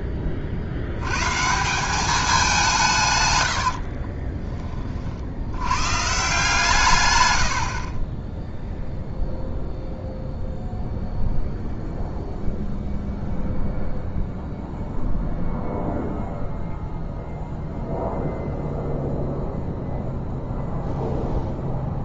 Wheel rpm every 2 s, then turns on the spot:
50, 170, 40, 130, 0, 0, 0, 0, 0, 0, 0.
none